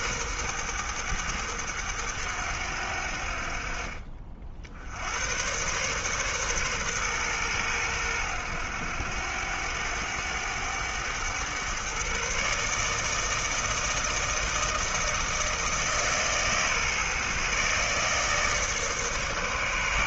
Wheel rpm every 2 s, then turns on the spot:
110, 80, 80, 120, 80, 100, 150, 160, 140, 150.
none